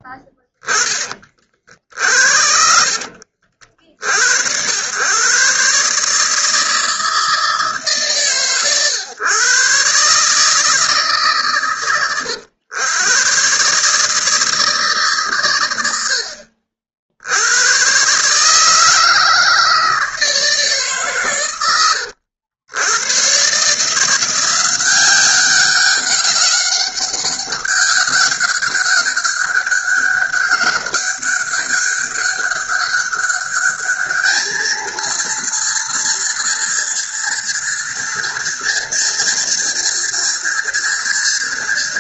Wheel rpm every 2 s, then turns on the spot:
20, 60, 70, 160, 130, 150, 100, 160, 60, 140, 160, 80, 170, 200, 200, 200, 200, 210, 230, 230, 230.
2-4